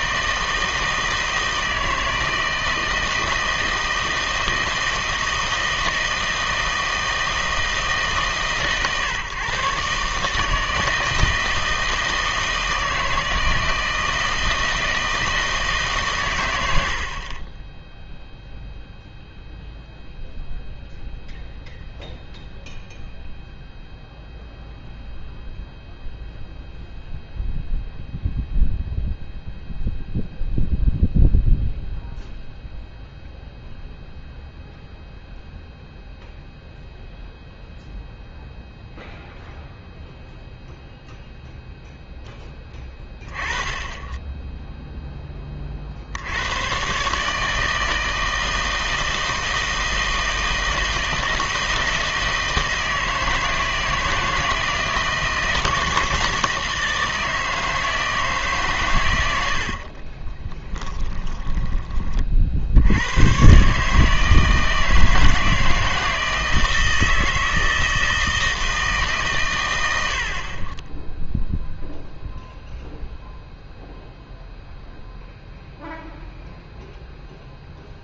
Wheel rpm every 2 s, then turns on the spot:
160, 160, 160, 160, 140, 160, 160, 160, 80, 0, 0, 0, 0, 0, 0, 0, 0, 0, 0, 0, 0, 10, 0, 120, 160, 160, 160, 160, 160, 130, 10, 70, 160, 160, 160, 20, 0, 0, 0.
60-62